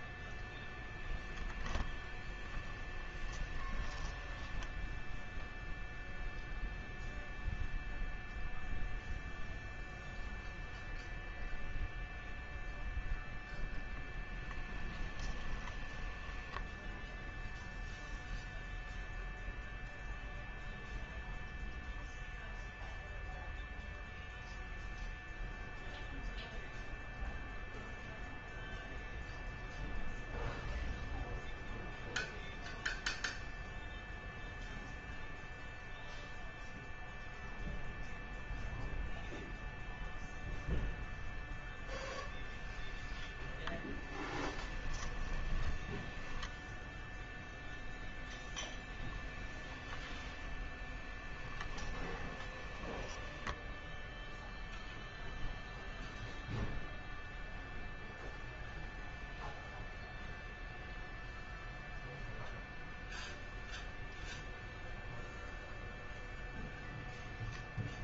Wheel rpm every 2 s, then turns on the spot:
20, 10, 0, 0, 0, 0, 0, 20, 0, 0, 0, 0, 0, 0, 0, 0, 0, 0, 0, 0, 0, 10, 10, 0, 10, 10, 10, 0, 0, 0, 0, 0, 0, 0.
2-4 14-16 42-46 50-54